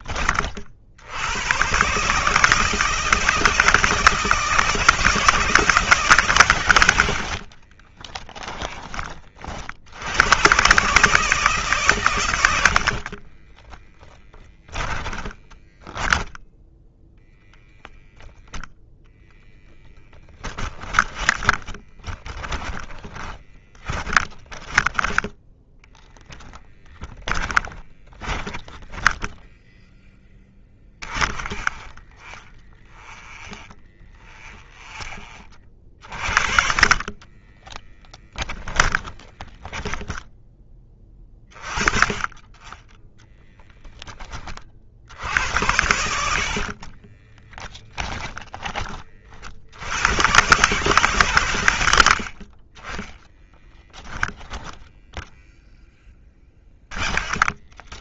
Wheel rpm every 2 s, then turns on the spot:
60, 160, 160, 110, 30, 140, 50, 20, 10, 10, 20, 20, 20, 10, 10, 20, 20, 20, 30, 10, 20, 20, 60, 30, 40, 140, 30, 10, 20.
6-8 12-18 20-24 26-34 36-40 46-48 52-54